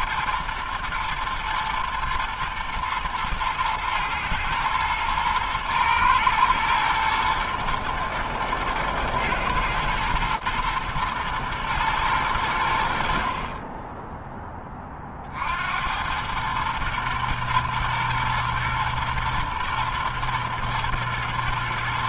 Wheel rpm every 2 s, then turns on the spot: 120, 110, 110, 110, 110, 110, 90, 10, 110, 120, 120.
none